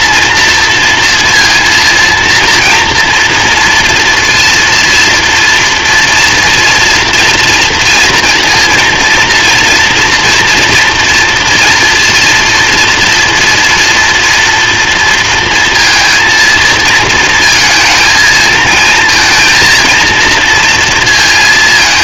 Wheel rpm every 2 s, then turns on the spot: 230, 230, 230, 230, 230, 230, 230, 230, 230, 220, 230.
none